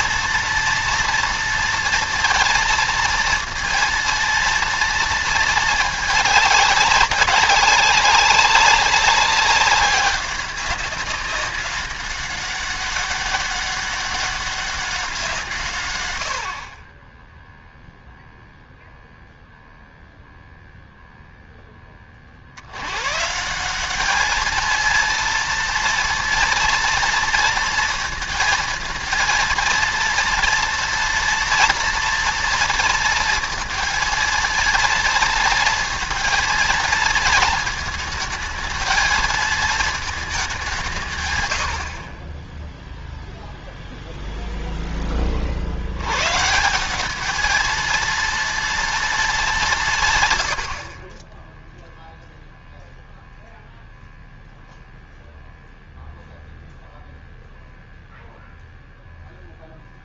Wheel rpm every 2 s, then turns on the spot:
230, 230, 230, 200, 200, 200, 200, 190, 50, 0, 0, 90, 220, 230, 230, 230, 230, 230, 230, 220, 180, 0, 10, 180, 230, 80, 0, 0, 0, 0.
none